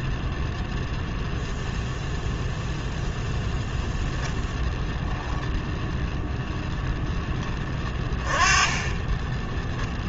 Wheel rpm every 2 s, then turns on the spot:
0, 0, 10, 0, 30.
8-10